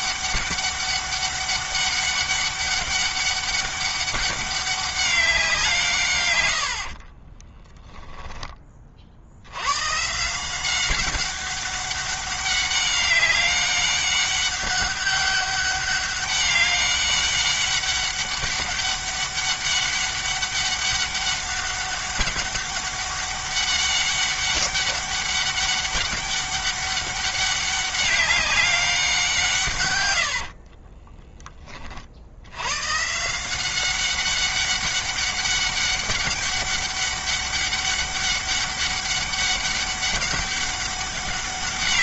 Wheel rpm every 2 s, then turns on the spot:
200, 200, 190, 50, 50, 190, 200, 200, 200, 200, 200, 200, 200, 200, 190, 30, 140, 200, 200, 200, 200.
6-8 30-32